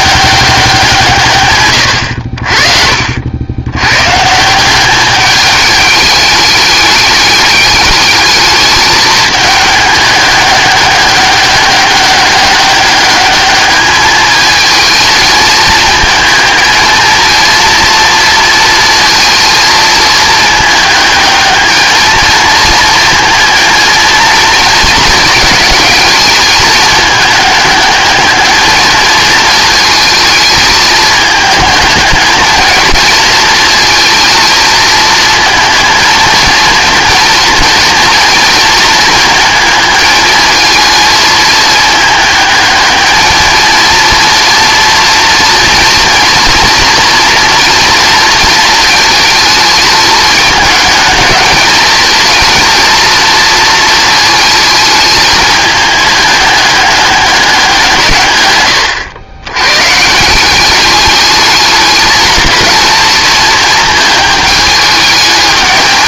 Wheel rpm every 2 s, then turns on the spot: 180, 50, 180, 210, 210, 200, 200, 220, 220, 230, 220, 230, 220, 220, 220, 220, 220, 220, 230, 230, 220, 210, 230, 230, 220, 220, 220, 220, 210, 120, 200, 220, 220.
none